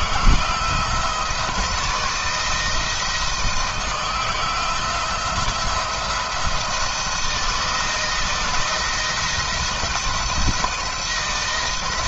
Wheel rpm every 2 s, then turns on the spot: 160, 160, 170, 170, 170, 170.
none